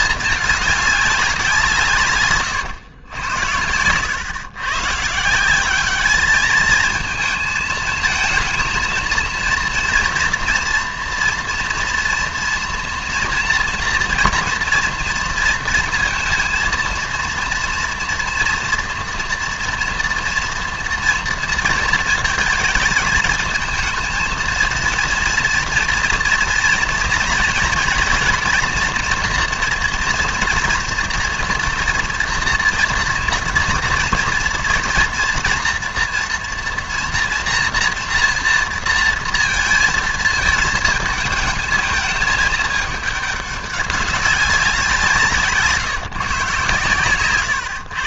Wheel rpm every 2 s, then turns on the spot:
210, 120, 120, 220, 230, 230, 230, 240, 230, 240, 230, 220, 230, 240, 240, 240, 230, 230, 230, 230, 220, 210, 190, 140.
none